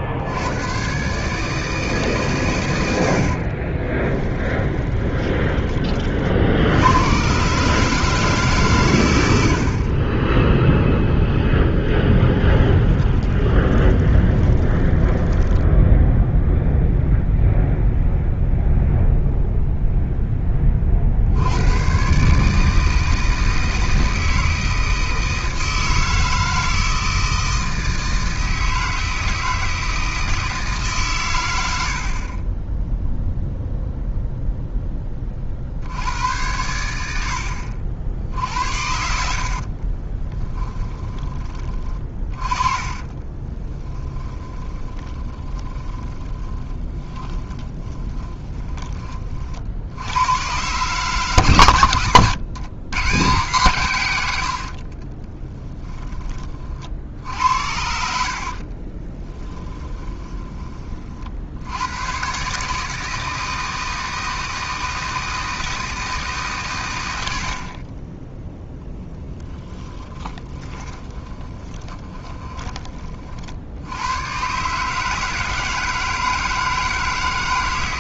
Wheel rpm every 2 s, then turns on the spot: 120, 90, 10, 70, 140, 0, 10, 10, 0, 0, 40, 160, 160, 160, 160, 160, 10, 10, 90, 60, 20, 30, 20, 30, 20, 140, 130, 60, 50, 40, 30, 150, 160, 120, 0, 20, 30, 150, 150.
4-6 12-16 40-48 54-56 58-60 70-72